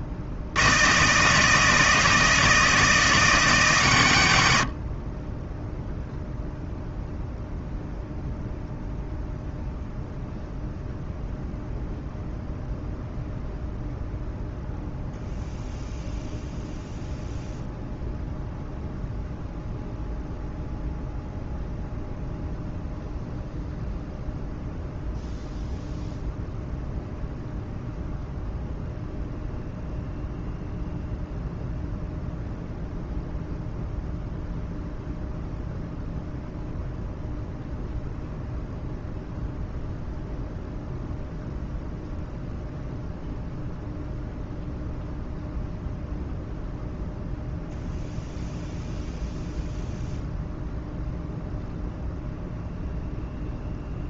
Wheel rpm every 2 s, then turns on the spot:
80, 160, 60, 0, 0, 0, 0, 0, 0, 0, 0, 0, 0, 0, 0, 0, 0, 0, 0, 0, 0, 0, 0, 0, 0, 0, 0.
none